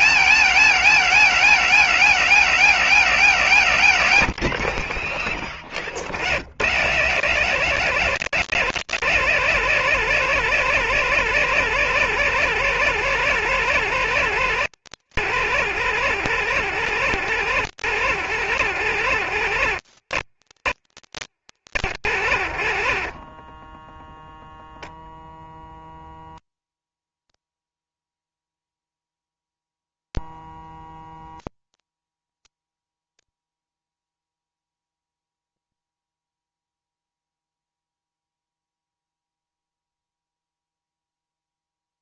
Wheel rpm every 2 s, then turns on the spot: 270, 260, 210, 180, 250, 230, 230, 230, 220, 220, 220, 210, 170, 170, 170, 170, 170, 170, 170, 170, 170.
none